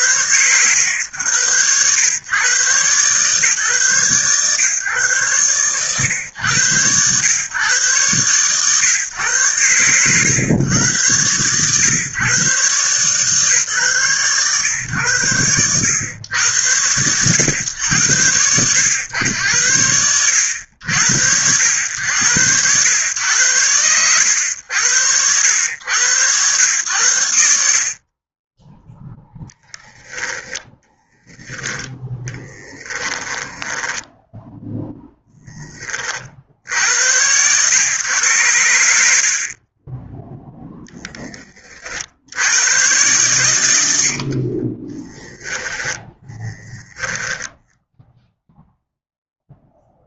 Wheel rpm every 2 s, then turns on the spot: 110, 140, 120, 110, 120, 120, 140, 100, 100, 100, 90, 100, 90, 90, 10, 10, 10, 10, 90, 80, 20, 140, 20, 10, 0.
30-34 44-46